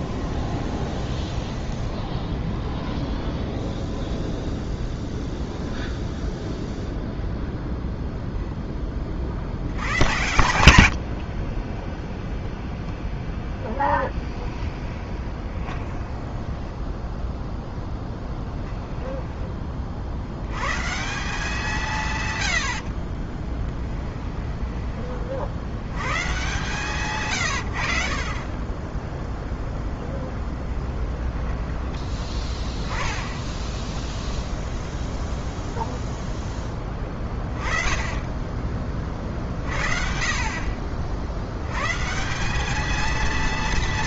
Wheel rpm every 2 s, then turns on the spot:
20, 20, 0, 0, 10, 110, 0, 0, 10, 10, 110, 90, 10, 130, 20, 10, 10, 10, 10, 30, 50, 200.
0-4 16-20 24-26 30-32